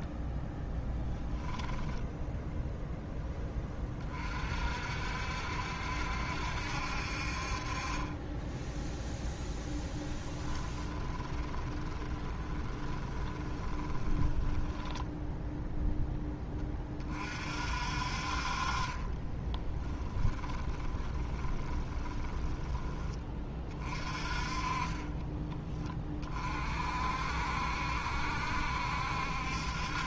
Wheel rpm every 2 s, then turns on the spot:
10, 0, 60, 60, 10, 20, 20, 10, 20, 30, 20, 20, 30, 50, 70.
0-2 10-16 20-22